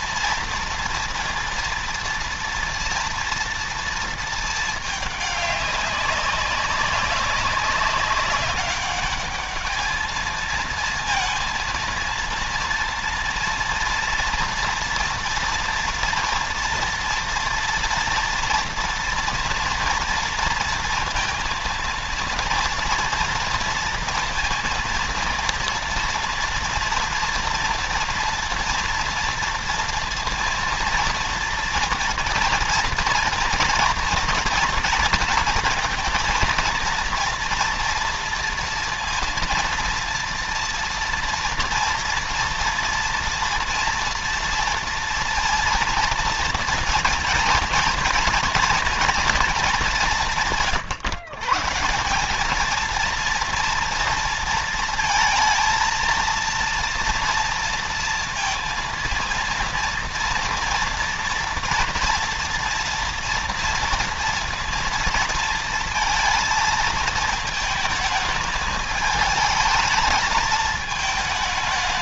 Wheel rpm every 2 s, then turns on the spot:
240, 230, 220, 200, 200, 220, 230, 230, 230, 230, 230, 230, 230, 230, 240, 230, 230, 240, 230, 230, 230, 240, 230, 230, 240, 180, 190, 230, 230, 230, 230, 230, 230, 230, 220, 220.
none